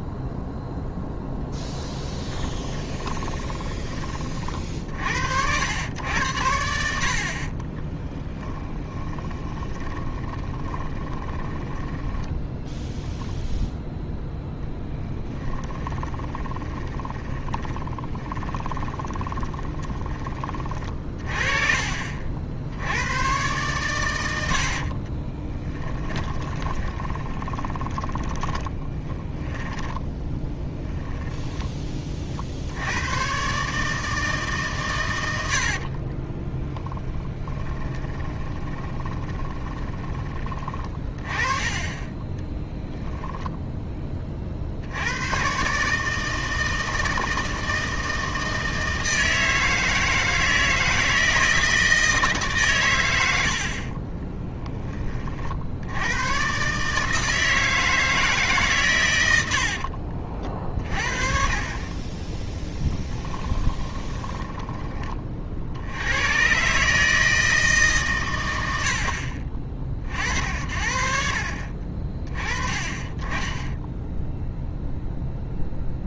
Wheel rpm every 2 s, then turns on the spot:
0, 20, 50, 80, 10, 20, 0, 10, 10, 30, 30, 80, 60, 20, 20, 10, 70, 140, 20, 20, 30, 10, 50, 160, 160, 160, 130, 20, 140, 140, 40, 20, 20, 130, 90, 60, 20, 0.
2-4 8-12 18-20 24-32 36-40 42-44 62-66